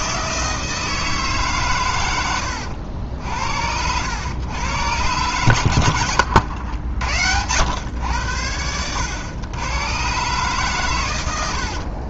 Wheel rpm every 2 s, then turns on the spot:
160, 90, 110, 90, 90, 130.
none